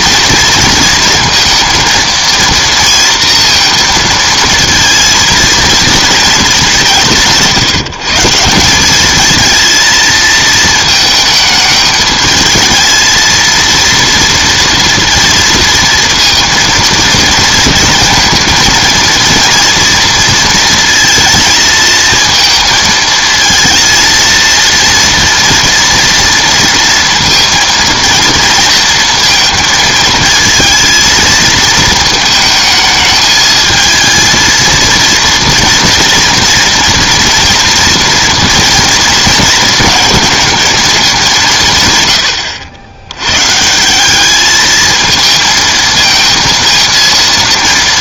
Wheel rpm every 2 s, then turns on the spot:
230, 230, 230, 170, 210, 220, 220, 230, 230, 230, 220, 230, 230, 230, 220, 220, 220, 230, 240, 230, 210, 110, 220, 230.
none